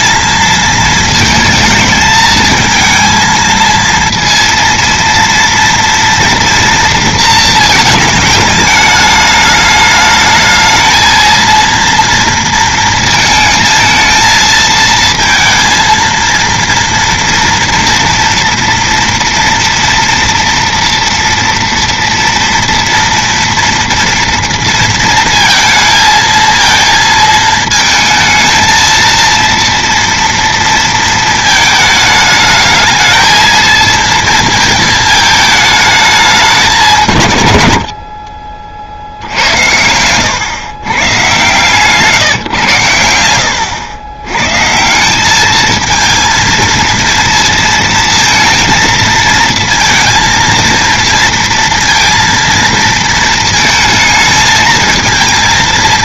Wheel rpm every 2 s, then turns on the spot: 220, 220, 230, 230, 210, 220, 230, 220, 230, 230, 230, 230, 230, 230, 220, 230, 220, 230, 190, 40, 130, 110, 140, 230, 230, 230, 230, 220.
none